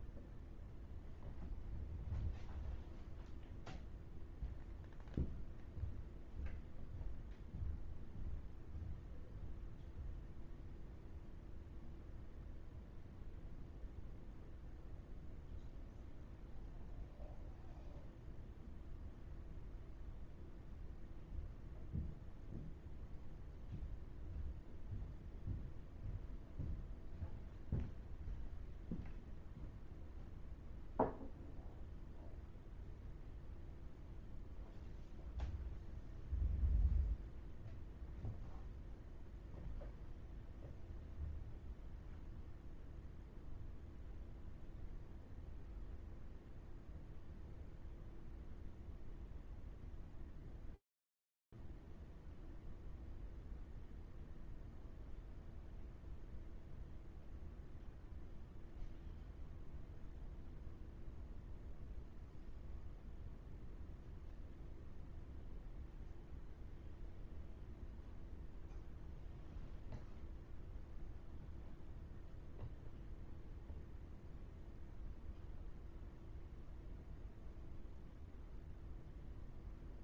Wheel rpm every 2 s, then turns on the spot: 0, 0, 0, 0, 0, 0, 0, 0, 0, 0, 0, 0, 0, 0, 0, 0, 0, 0, 0, 0, 0, 0, 0, 0, 0, 0, 0, 0, 0, 0, 0, 0, 0, 0, 0, 0, 0, 0, 0, 0.
none